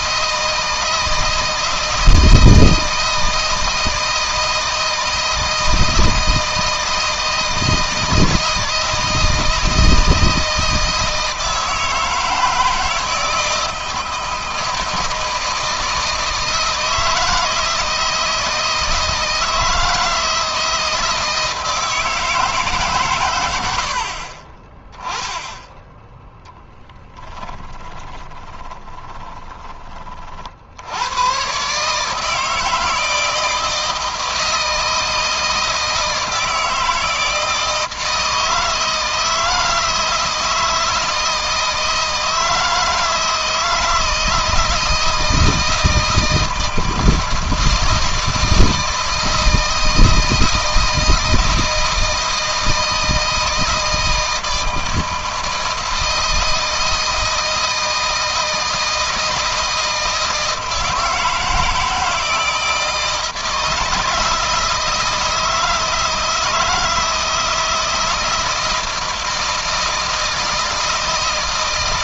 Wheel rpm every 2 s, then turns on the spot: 160, 160, 160, 160, 160, 160, 160, 160, 160, 160, 160, 140, 20, 10, 20, 90, 160, 160, 160, 160, 160, 160, 160, 160, 160, 160, 160, 160, 160, 160, 160, 160, 160, 160, 170, 160.
26-30